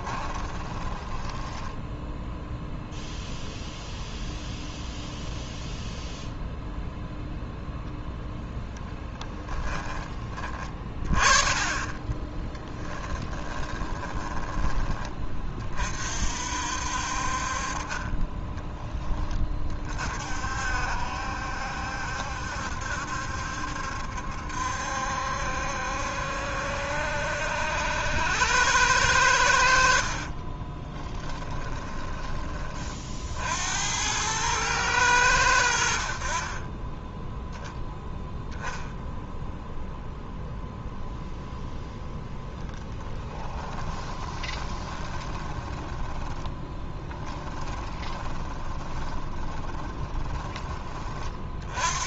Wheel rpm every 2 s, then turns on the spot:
20, 0, 0, 0, 10, 30, 10, 20, 60, 10, 60, 70, 70, 70, 100, 30, 30, 110, 30, 0, 0, 10, 20, 20, 20, 20.
0-2 8-10 12-14 30-32 44-50